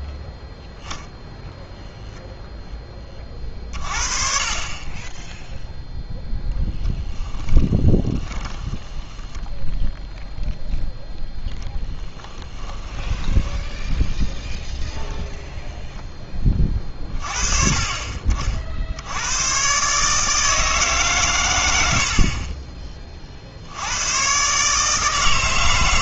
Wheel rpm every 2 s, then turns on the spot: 0, 0, 30, 10, 10, 0, 20, 0, 30, 60, 150, 40, 140.
8-10 12-14